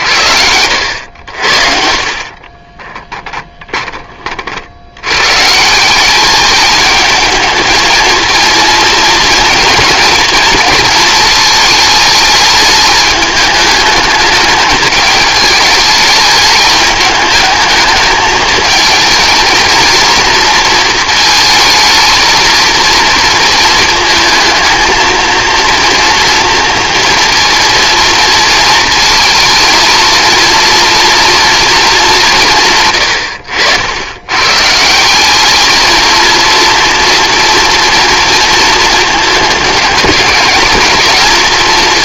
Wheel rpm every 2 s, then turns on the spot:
70, 20, 70, 210, 220, 230, 210, 210, 210, 220, 230, 230, 220, 230, 220, 230, 140, 140, 230, 230, 220.
2-4